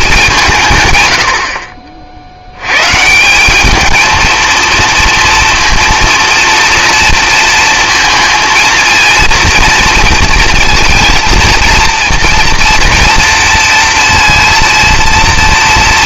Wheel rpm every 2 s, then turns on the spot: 140, 120, 230, 230, 230, 230, 230, 230.
none